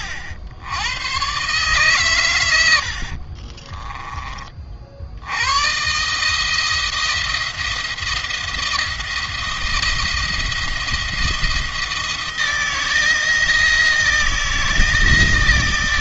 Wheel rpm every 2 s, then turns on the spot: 100, 70, 60, 160, 170, 170, 160, 170.
2-4